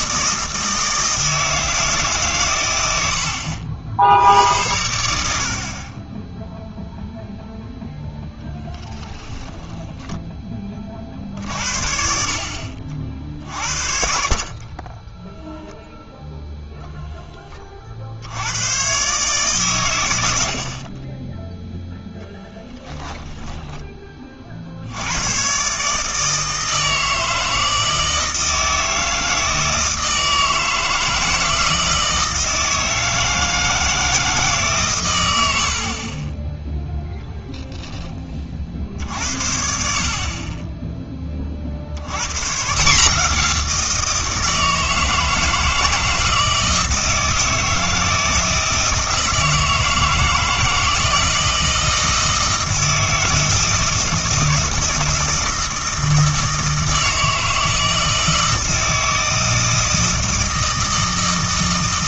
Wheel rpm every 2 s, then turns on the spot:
160, 100, 90, 0, 0, 30, 50, 20, 0, 110, 60, 10, 60, 160, 160, 160, 160, 140, 0, 50, 20, 150, 160, 160, 160, 160, 160, 160, 160, 160, 160.
22-24